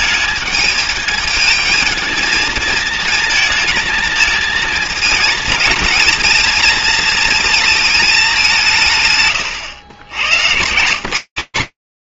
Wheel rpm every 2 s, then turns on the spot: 220, 220, 230, 230, 170, 90.
none